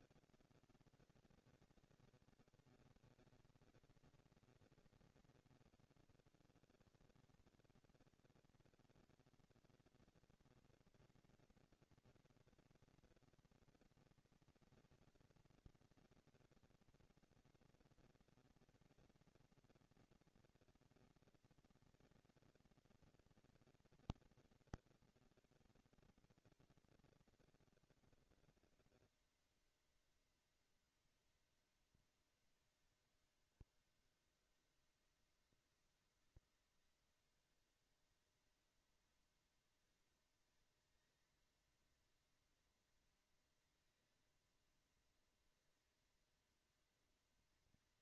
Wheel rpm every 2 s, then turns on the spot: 230, 210, 200, 120, 230, 230, 230, 230, 230, 220, 230, 230, 230, 230, 230, 230, 220, 200, 200, 220, 220, 230, 230, 230.
none